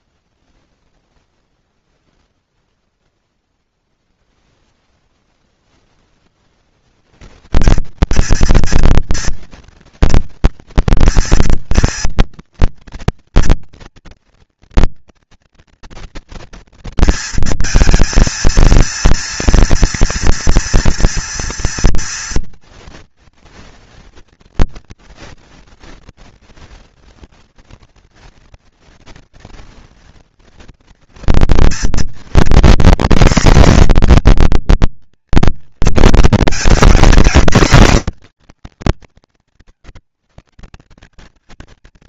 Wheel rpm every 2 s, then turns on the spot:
0, 0, 0, 140, 230, 230, 230, 230, 230, 230, 230, 240, 230, 230, 230, 230, 250, 230, 230, 150, 210.
none